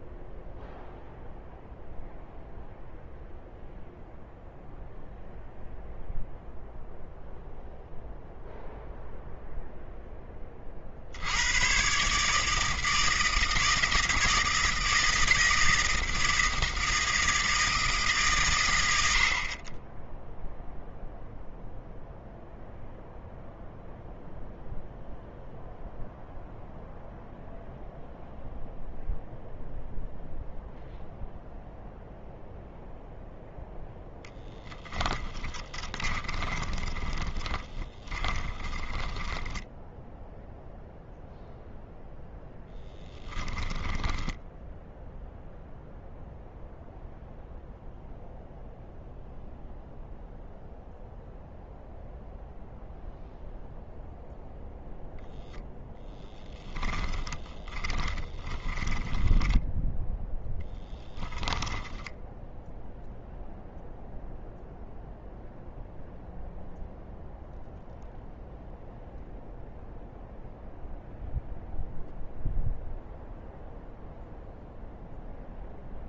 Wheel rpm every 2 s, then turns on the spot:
0, 0, 0, 0, 0, 50, 160, 160, 160, 100, 0, 0, 0, 0, 0, 0, 0, 10, 20, 10, 0, 10, 0, 0, 0, 0, 0, 0, 20, 10, 10, 0, 0, 0, 0, 0, 0, 0.
34-40 56-62